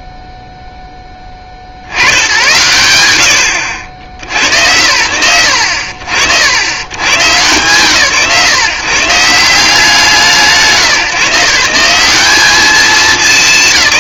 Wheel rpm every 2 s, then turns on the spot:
0, 110, 80, 80, 150, 150, 220.
none